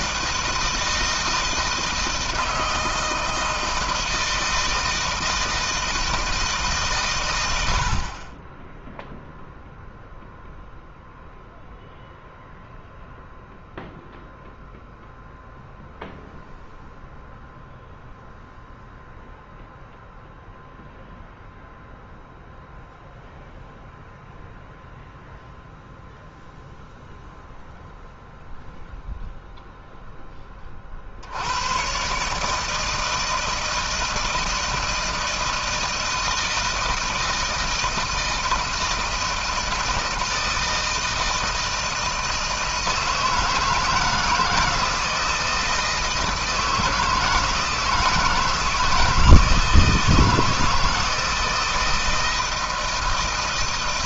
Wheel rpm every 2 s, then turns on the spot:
160, 160, 160, 130, 10, 0, 0, 0, 0, 0, 0, 0, 0, 0, 0, 50, 160, 160, 160, 160, 160, 160, 160, 160, 160, 160, 160.
none